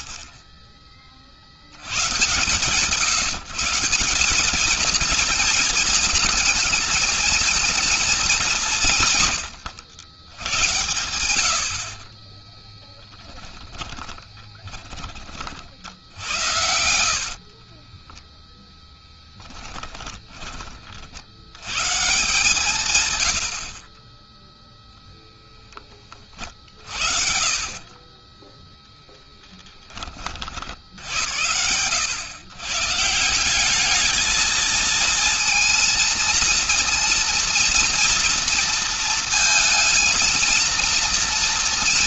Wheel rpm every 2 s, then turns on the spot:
40, 160, 220, 220, 160, 90, 20, 40, 70, 10, 50, 130, 0, 40, 10, 80, 160, 230, 230, 230, 230.
12-14 16-20 26-28